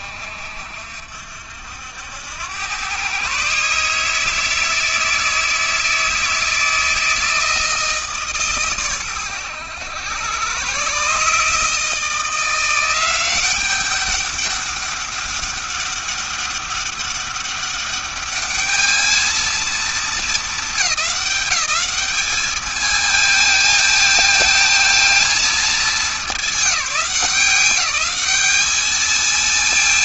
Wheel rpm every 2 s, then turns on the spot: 60, 110, 160, 160, 130, 130, 180, 200, 200, 210, 210, 220, 220, 190, 210.
none